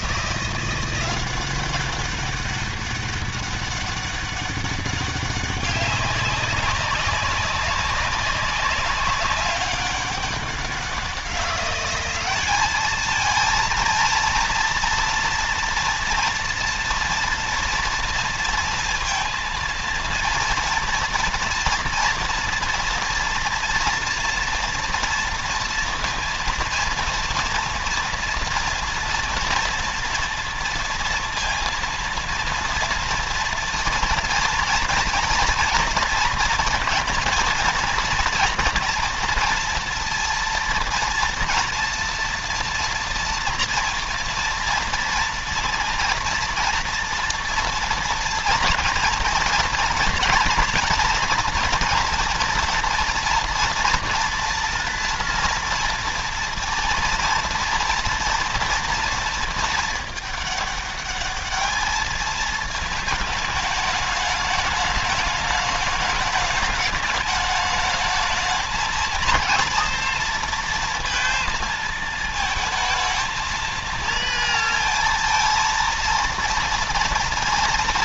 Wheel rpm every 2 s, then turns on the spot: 180, 190, 200, 200, 200, 190, 200, 230, 230, 230, 230, 230, 230, 230, 230, 230, 230, 230, 230, 230, 230, 230, 230, 230, 230, 230, 240, 230, 230, 230, 210, 220, 210, 210, 210, 230, 220, 230, 230.
none